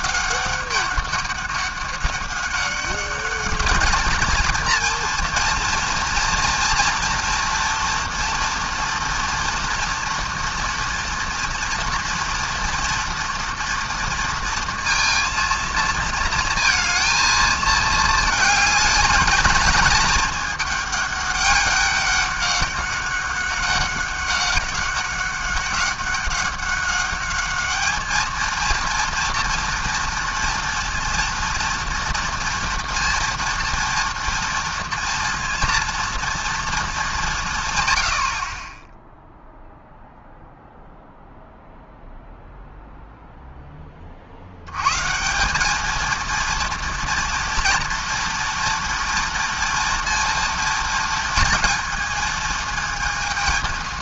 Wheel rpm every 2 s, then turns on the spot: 200, 200, 230, 230, 230, 230, 240, 230, 220, 220, 210, 190, 190, 200, 230, 230, 230, 230, 220, 10, 0, 0, 110, 230, 230, 230, 220.
none